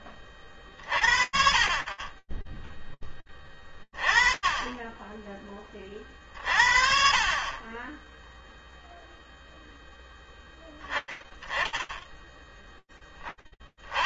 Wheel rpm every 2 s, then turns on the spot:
30, 20, 30, 20, 0, 10, 10.
none